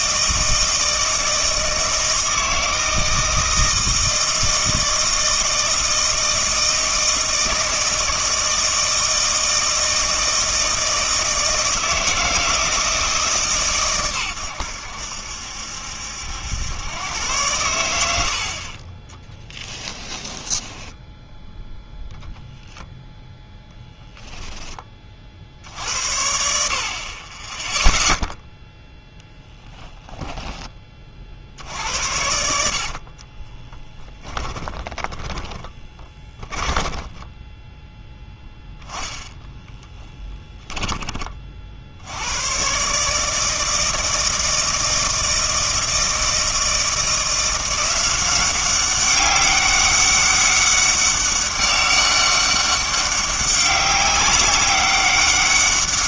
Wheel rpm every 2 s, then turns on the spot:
160, 160, 160, 160, 160, 160, 160, 90, 100, 30, 10, 0, 10, 50, 0, 20, 70, 10, 20, 0, 20, 120, 160, 160, 190, 200, 200, 190.
18-22 32-38 40-42